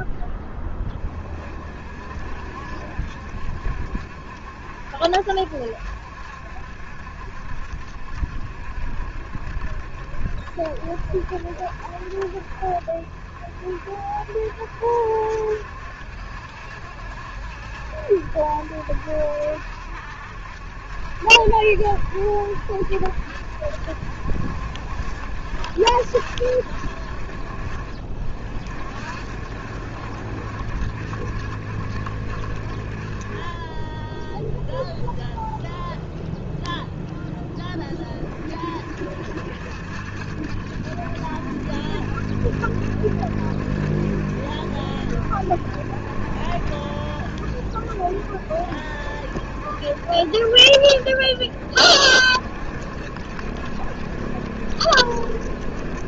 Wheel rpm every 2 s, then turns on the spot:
40, 60, 60, 60, 60, 60, 50, 70, 70, 70, 70, 70, 70, 60, 60, 70, 40, 0, 0, 60, 70, 70, 70, 60, 60, 50, 70, 70.
none